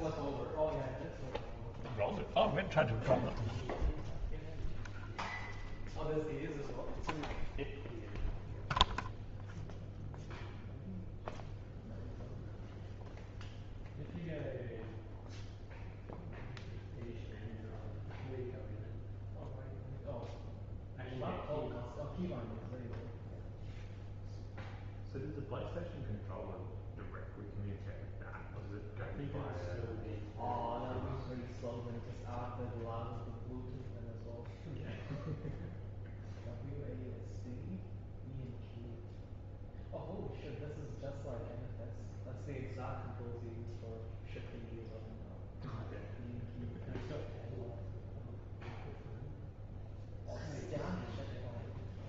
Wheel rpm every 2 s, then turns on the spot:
0, 0, 0, 0, 0, 0, 0, 0, 0, 0, 0, 0, 0, 0, 0, 0, 0, 0, 0, 0, 0, 0, 0, 0, 0, 0.
none